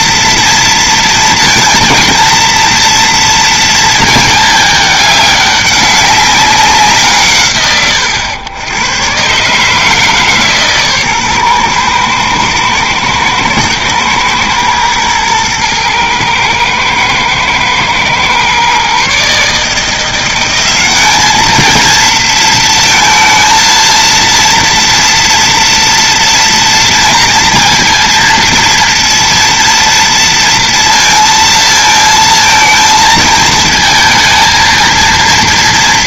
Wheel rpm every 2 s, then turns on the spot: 230, 230, 210, 170, 110, 140, 120, 110, 110, 130, 190, 230, 230, 230, 230, 230, 220, 230.
none